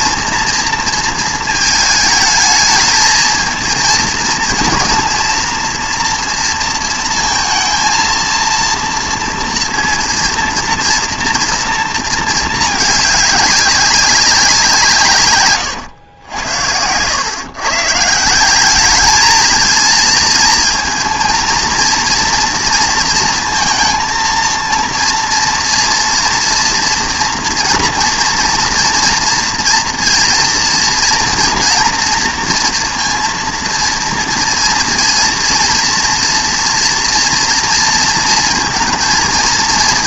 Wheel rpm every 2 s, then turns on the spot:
230, 220, 230, 230, 230, 230, 220, 160, 90, 200, 230, 240, 230, 240, 230, 230, 230, 230, 230, 230.
none